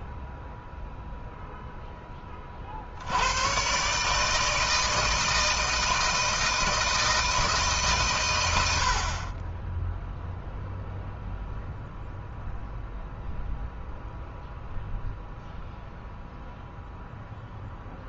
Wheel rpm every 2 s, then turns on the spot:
0, 40, 150, 160, 90, 0, 0, 0, 0.
none